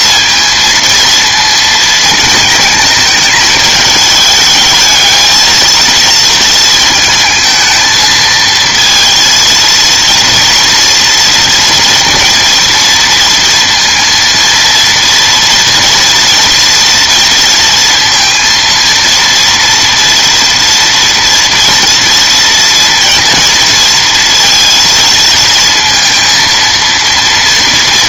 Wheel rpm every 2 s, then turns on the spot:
230, 220, 220, 230, 230, 230, 230, 230, 230, 230, 230, 230, 230, 230.
none